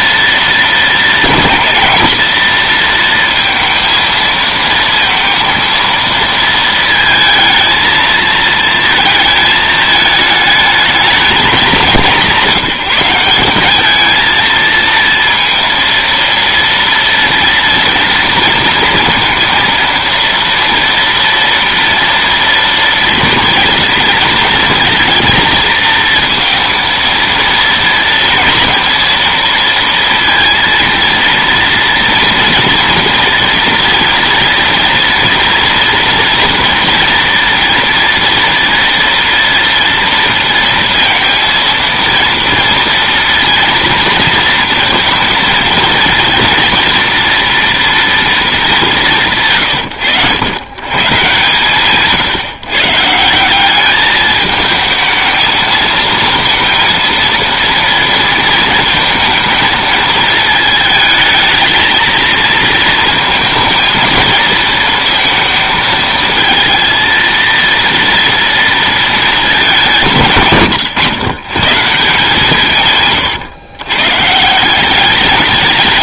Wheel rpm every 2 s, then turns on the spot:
230, 230, 230, 230, 230, 220, 190, 230, 230, 230, 230, 230, 230, 230, 230, 230, 230, 230, 230, 230, 230, 230, 230, 230, 210, 110, 150, 220, 230, 230, 220, 230, 230, 230, 230, 120, 140, 160.
none